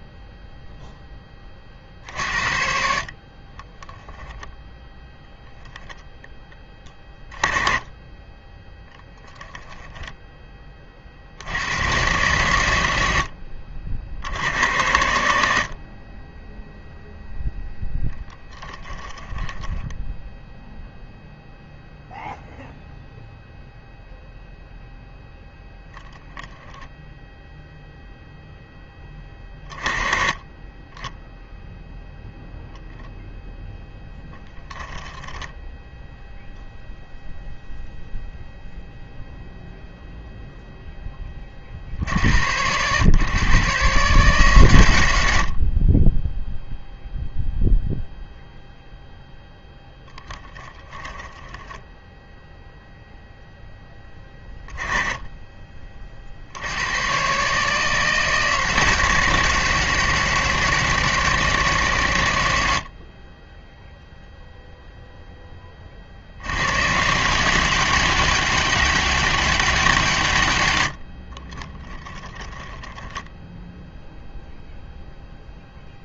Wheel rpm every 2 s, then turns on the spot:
0, 60, 0, 20, 10, 20, 110, 80, 10, 20, 0, 0, 0, 0, 10, 20, 0, 10, 0, 0, 0, 100, 120, 0, 0, 10, 0, 20, 80, 160, 160, 60, 0, 120, 200, 110, 20, 0.
18-20 50-52 72-74